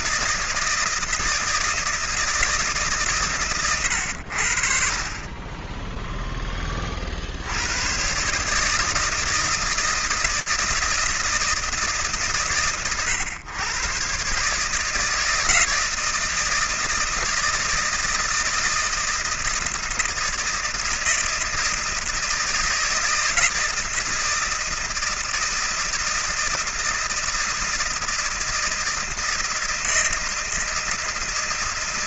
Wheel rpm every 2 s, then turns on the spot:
160, 150, 50, 20, 150, 160, 110, 150, 160, 160, 160, 160, 160, 160, 160, 170.
none